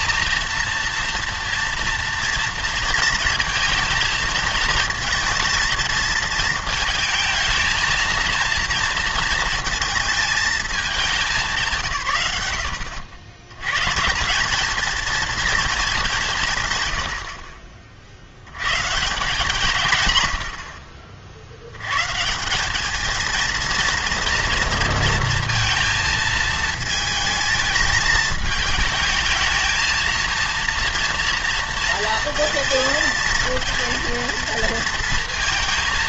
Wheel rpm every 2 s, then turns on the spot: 230, 230, 220, 230, 230, 220, 90, 210, 130, 110, 70, 190, 230, 220, 220, 230, 230, 230.
20-22